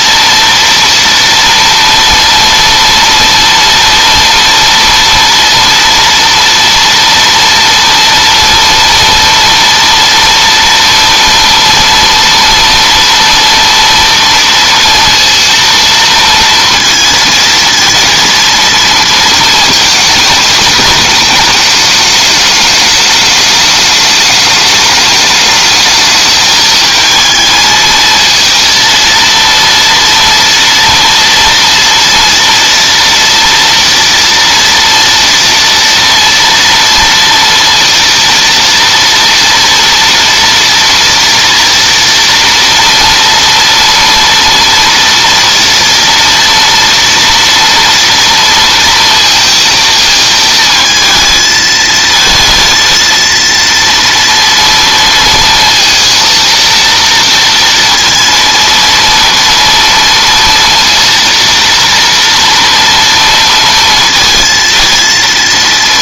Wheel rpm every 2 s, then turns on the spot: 230, 230, 230, 230, 230, 230, 230, 230, 230, 230, 210, 220, 210, 210, 220, 230, 230, 230, 230, 230, 230, 230, 230, 230, 230, 220, 220, 240, 230, 230, 230, 230, 230.
none